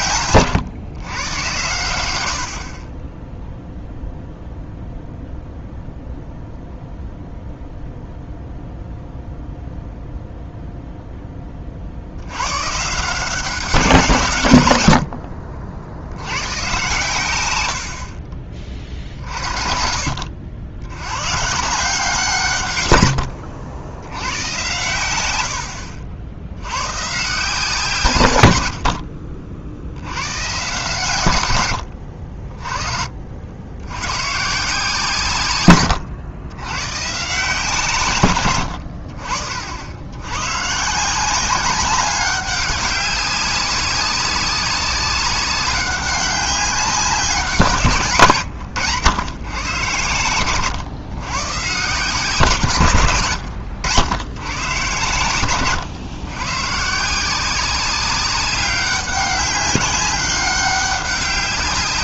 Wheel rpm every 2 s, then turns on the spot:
120, 50, 0, 0, 0, 0, 130, 130, 110, 40, 80, 130, 100, 100, 90, 130, 40, 160, 110, 110, 130, 200, 200, 190, 120, 110, 150, 120, 130, 190, 200.
none